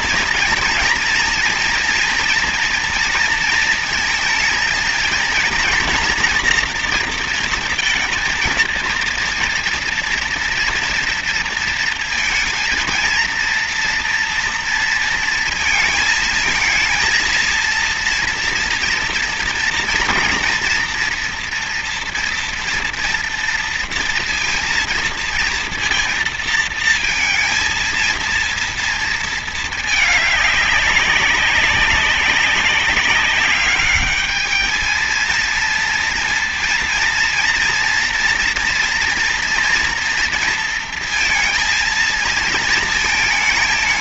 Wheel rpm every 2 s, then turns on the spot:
230, 230, 230, 240, 230, 230, 230, 230, 230, 230, 240, 230, 230, 230, 230, 200, 200, 210, 230, 230, 230, 230.
none